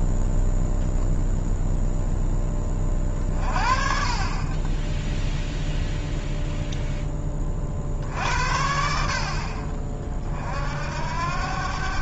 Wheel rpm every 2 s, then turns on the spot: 0, 20, 20, 0, 60, 70.
none